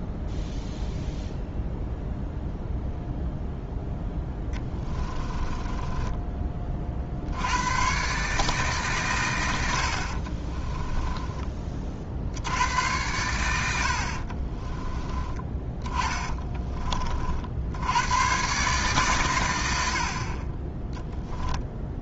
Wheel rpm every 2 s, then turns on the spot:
0, 0, 20, 40, 130, 20, 90, 30, 30, 130, 10.
4-6 10-12 14-16